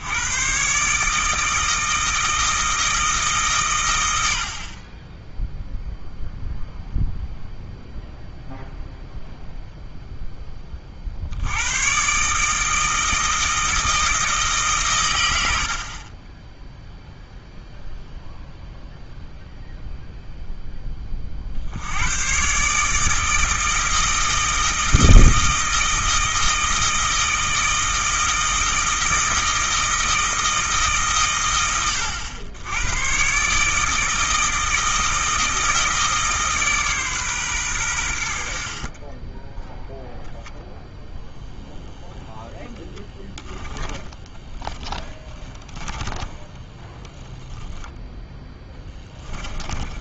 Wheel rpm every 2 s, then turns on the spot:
140, 160, 40, 0, 0, 30, 160, 140, 0, 0, 20, 150, 160, 160, 160, 150, 100, 160, 140, 50, 0, 10, 10, 10, 10.
44-46 48-50